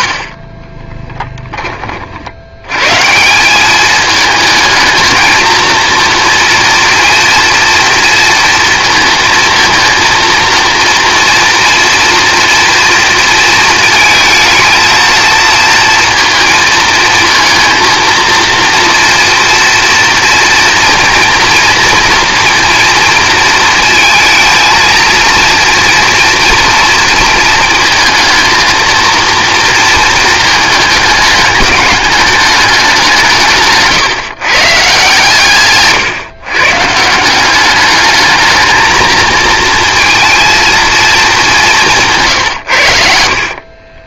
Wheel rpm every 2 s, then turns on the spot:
20, 130, 220, 230, 230, 230, 230, 220, 230, 230, 230, 230, 230, 230, 230, 220, 190, 150, 140, 220, 220, 100.
0-2